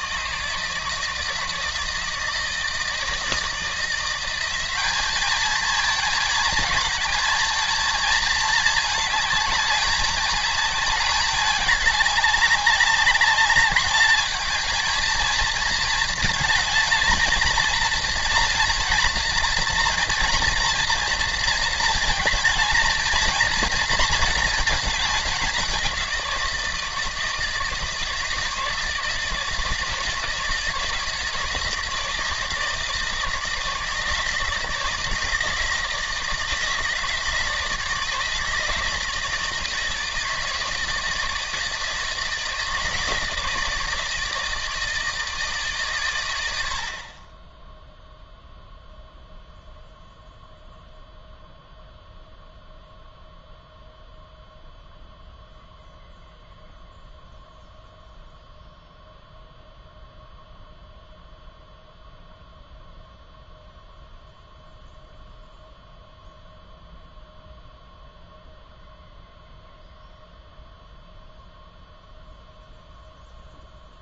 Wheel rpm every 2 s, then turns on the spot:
160, 160, 190, 220, 220, 210, 200, 220, 230, 240, 230, 220, 220, 170, 160, 160, 160, 160, 160, 160, 160, 160, 160, 80, 0, 0, 0, 0, 0, 0, 0, 0, 0, 0, 0, 0, 0.
none